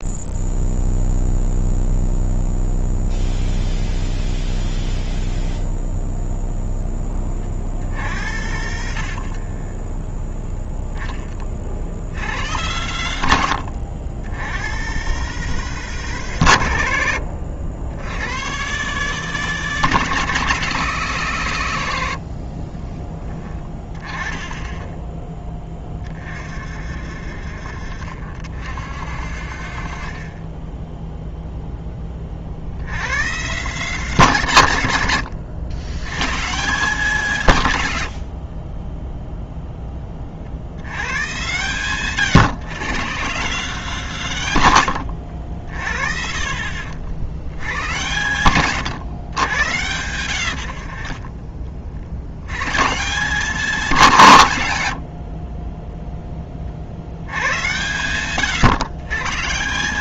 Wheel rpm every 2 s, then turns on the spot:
0, 0, 0, 0, 70, 20, 90, 100, 110, 120, 160, 40, 10, 50, 60, 20, 60, 160, 160, 30, 60, 140, 150, 60, 120, 60, 130, 150, 30, 110.
8-12 22-24 30-32 38-40 46-48 50-52